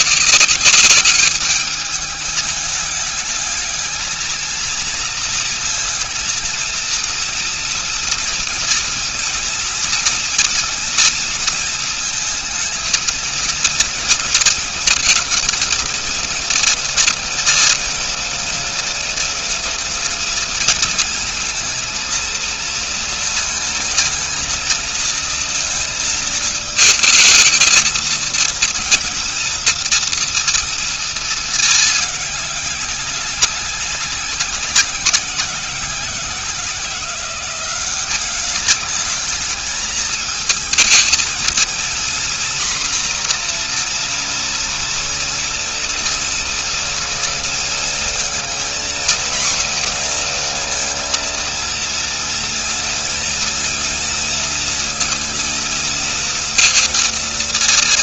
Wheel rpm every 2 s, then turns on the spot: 190, 210, 230, 230, 230, 230, 220, 220, 230, 230, 230, 230, 230, 220, 230, 230, 210, 190, 180, 200, 220, 240, 240, 230, 230, 240, 230, 230, 230.
none